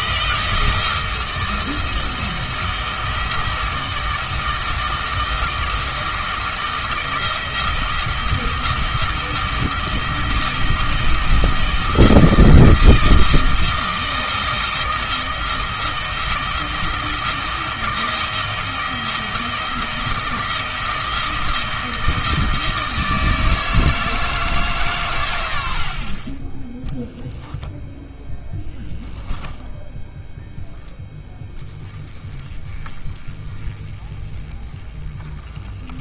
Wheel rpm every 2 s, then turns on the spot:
160, 160, 160, 170, 160, 160, 160, 160, 160, 160, 160, 160, 150, 10, 10, 0, 20, 20.
none